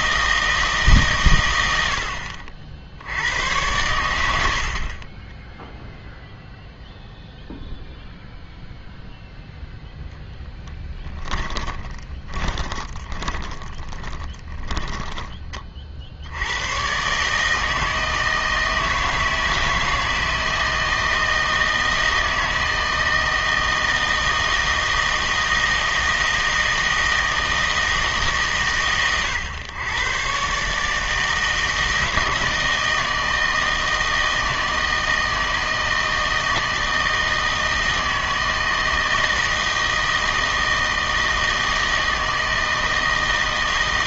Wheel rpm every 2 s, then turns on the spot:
160, 60, 60, 0, 0, 10, 20, 10, 100, 160, 160, 160, 160, 160, 140, 140, 160, 160, 160, 160, 160, 160.
4-6 10-16